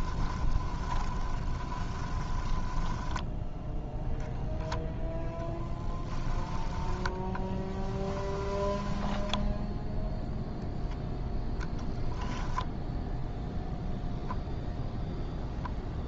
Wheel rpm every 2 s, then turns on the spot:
20, 0, 10, 10, 0, 10, 0, 0.
0-2 4-8 10-12